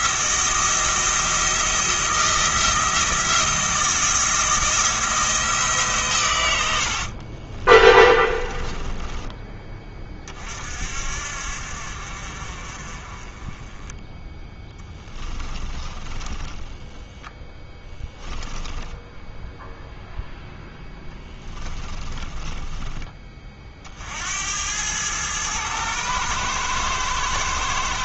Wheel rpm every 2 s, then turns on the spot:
170, 170, 170, 80, 20, 40, 40, 10, 10, 10, 10, 20, 90, 110.
6-10 14-24